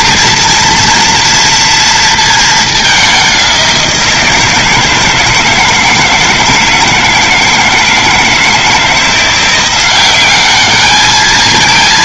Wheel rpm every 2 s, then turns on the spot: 230, 220, 170, 160, 160, 190.
none